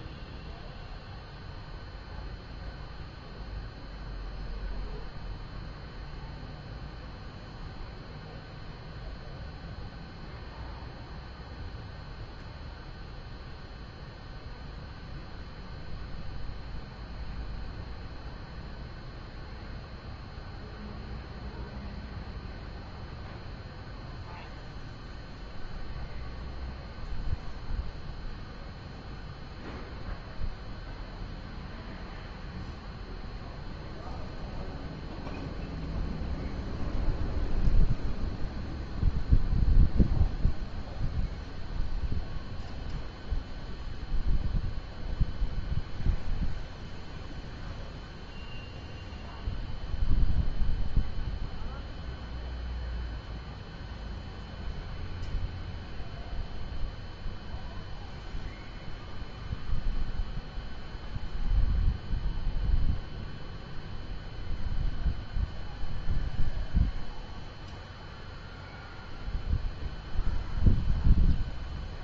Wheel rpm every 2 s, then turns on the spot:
0, 0, 0, 0, 0, 0, 0, 0, 0, 0, 0, 0, 0, 0, 0, 0, 0, 0, 0, 0, 0, 0, 0, 0, 0, 0, 0, 0, 0, 0, 0, 0, 0, 0, 0, 0.
none